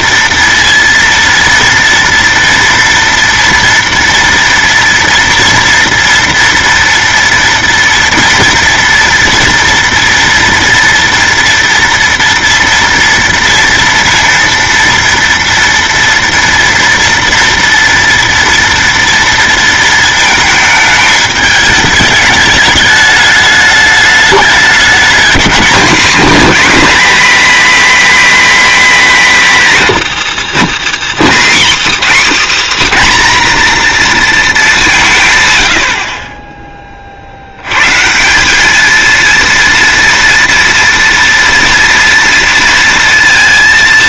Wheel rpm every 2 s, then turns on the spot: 230, 230, 230, 230, 230, 230, 240, 230, 230, 230, 220, 210, 210, 250, 250, 210, 270, 200, 20, 200, 230, 230.
none